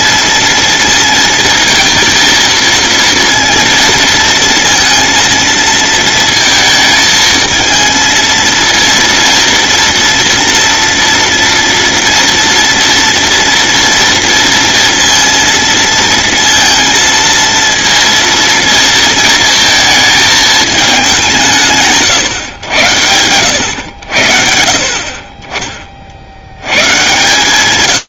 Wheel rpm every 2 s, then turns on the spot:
230, 230, 230, 220, 230, 230, 230, 230, 230, 230, 210, 90, 40, 120.
none